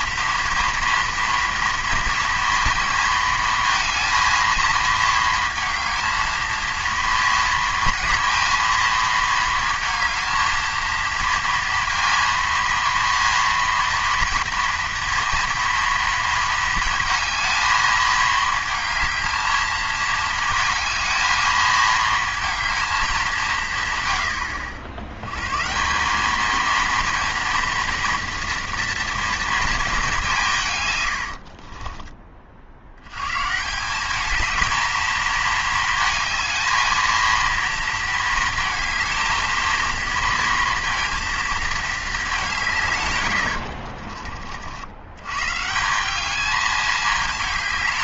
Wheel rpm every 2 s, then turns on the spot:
230, 230, 230, 230, 230, 230, 230, 230, 230, 220, 220, 220, 80, 210, 230, 150, 50, 220, 220, 230, 230, 170, 60, 210.
none